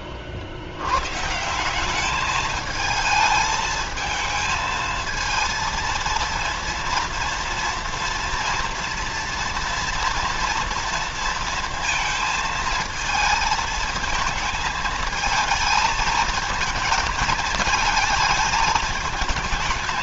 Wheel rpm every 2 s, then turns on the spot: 100, 210, 220, 230, 240, 230, 220, 220, 220, 220.
none